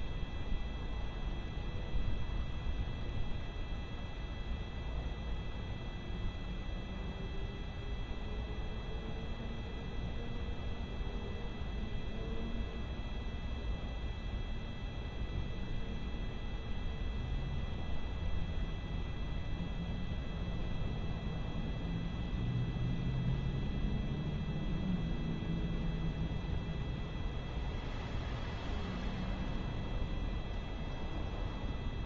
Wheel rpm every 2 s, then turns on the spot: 0, 0, 0, 0, 0, 0, 0, 0, 0, 0, 0, 0, 0, 0, 0, 0.
none